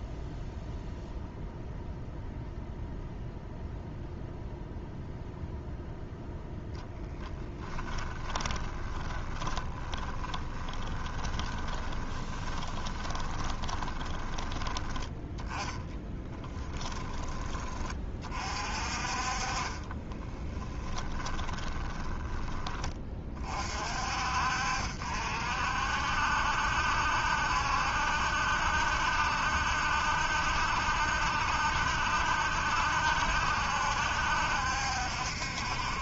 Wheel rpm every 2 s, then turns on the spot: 0, 0, 0, 10, 20, 20, 20, 20, 10, 40, 10, 20, 60, 70, 70, 70, 70, 70.
8-14 16-18 20-22